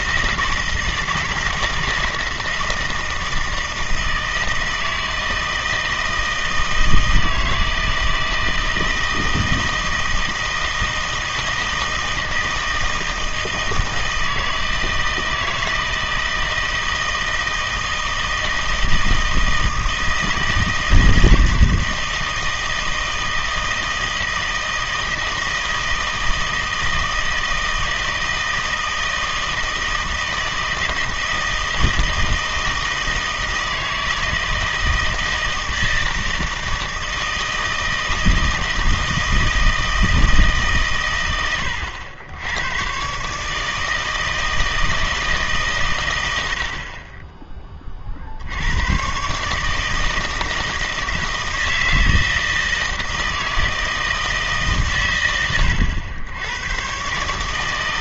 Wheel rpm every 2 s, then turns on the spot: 160, 160, 160, 160, 160, 160, 160, 160, 160, 160, 160, 160, 160, 160, 160, 160, 160, 160, 160, 160, 150, 100, 160, 80, 90, 160, 160, 140, 100.
none